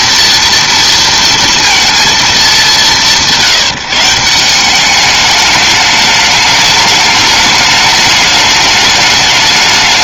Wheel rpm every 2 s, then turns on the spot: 230, 200, 180, 210, 210.
none